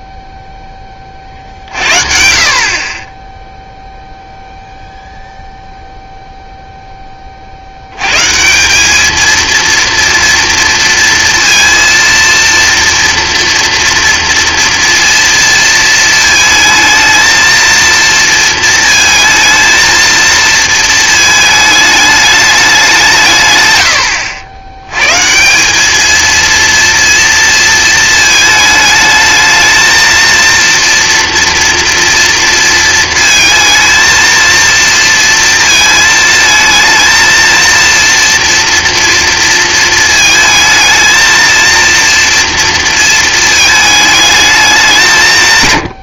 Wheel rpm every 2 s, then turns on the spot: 10, 50, 0, 0, 170, 230, 230, 230, 220, 230, 220, 200, 100, 230, 220, 230, 230, 230, 220, 230, 220, 230, 200.
none